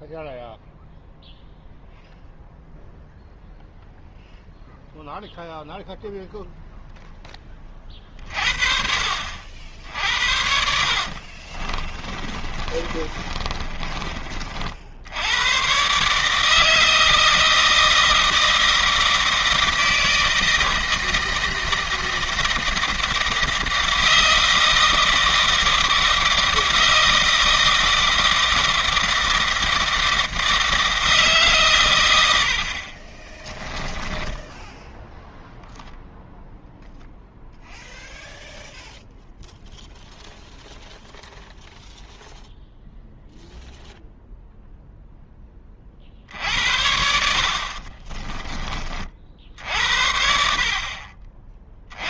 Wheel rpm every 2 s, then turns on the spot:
0, 0, 0, 0, 50, 60, 40, 80, 160, 160, 160, 160, 160, 160, 160, 160, 50, 0, 0, 0, 0, 0, 0, 70, 30, 50.
10-14